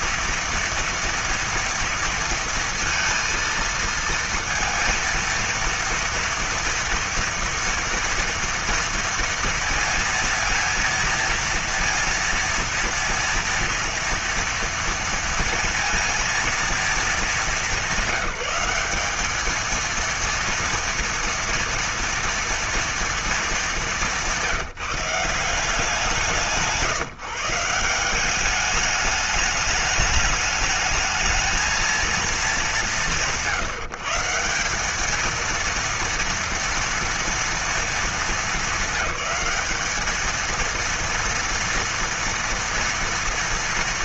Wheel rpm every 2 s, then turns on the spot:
230, 230, 230, 230, 230, 230, 230, 230, 230, 190, 230, 230, 180, 170, 200, 210, 200, 170, 230, 210, 230, 230.
none